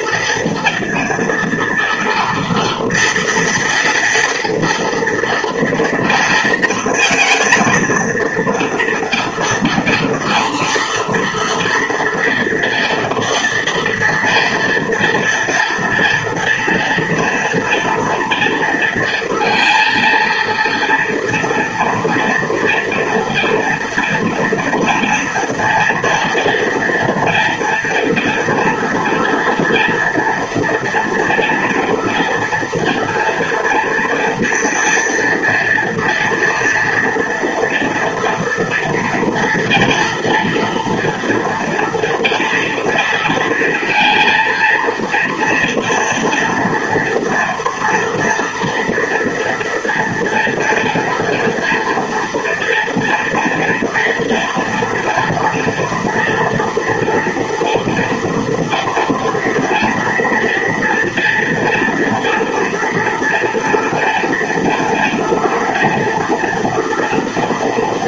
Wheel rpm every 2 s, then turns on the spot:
230, 230, 240, 230, 230, 240, 230, 230, 230, 230, 230, 230, 230, 240, 240, 230, 230, 230, 240, 230, 230, 230, 230, 230, 230, 230, 230, 230, 240, 240, 230, 230, 230, 230.
none